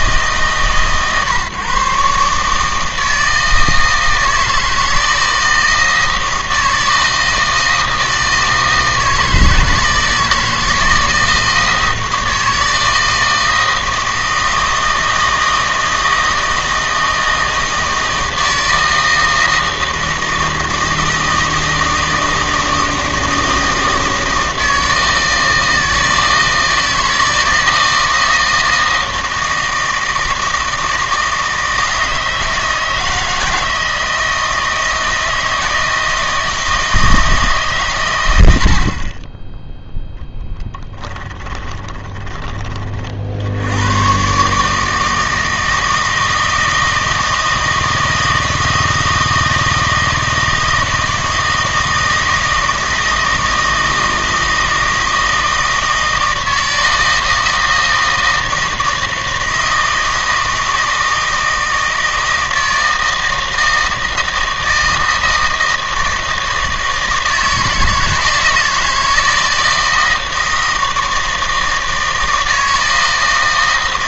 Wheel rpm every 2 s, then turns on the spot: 150, 160, 160, 160, 160, 160, 160, 160, 160, 160, 160, 160, 160, 160, 160, 160, 160, 160, 160, 60, 10, 20, 150, 160, 160, 160, 160, 160, 160, 160, 160, 160, 160, 160, 160, 160, 160.
40-42